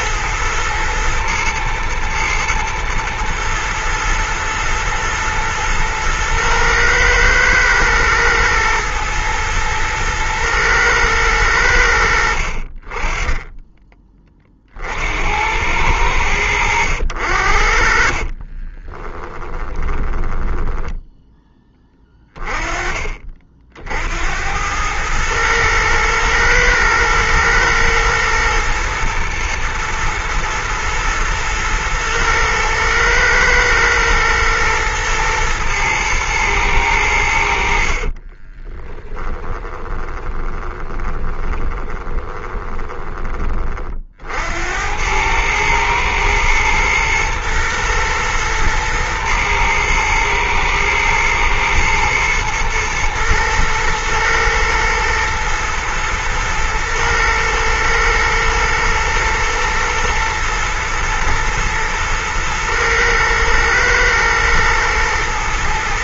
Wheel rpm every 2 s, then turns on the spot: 110, 120, 110, 110, 120, 110, 20, 70, 80, 20, 10, 30, 100, 110, 110, 110, 110, 110, 100, 20, 20, 20, 90, 120, 120, 120, 110, 120, 120, 110, 110, 110, 110.
18-20 38-44